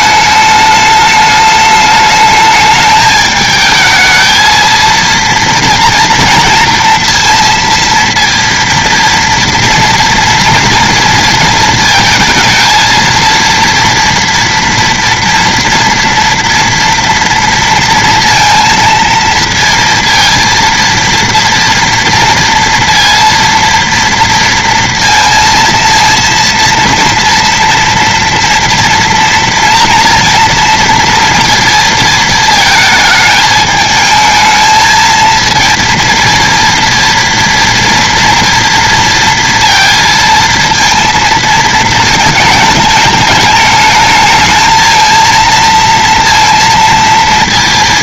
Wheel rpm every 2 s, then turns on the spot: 210, 210, 230, 230, 230, 230, 230, 230, 230, 230, 230, 230, 230, 230, 230, 230, 220, 230, 230, 230, 230, 210, 230, 230.
none